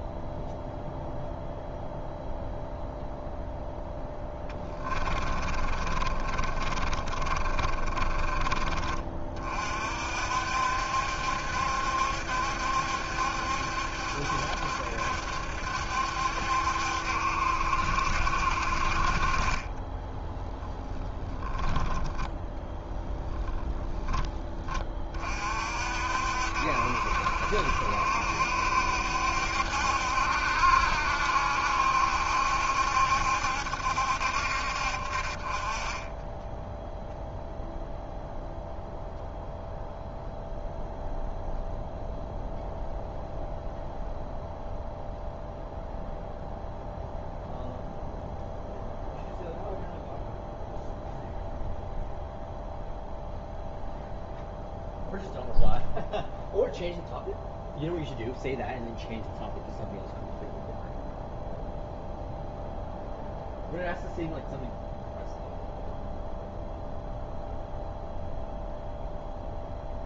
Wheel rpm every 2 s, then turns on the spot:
0, 0, 10, 30, 30, 60, 70, 70, 70, 50, 10, 10, 20, 60, 70, 70, 70, 50, 0, 0, 0, 0, 0, 0, 0, 0, 0, 0, 0, 0, 0, 0, 0, 0, 0.
4-8 22-24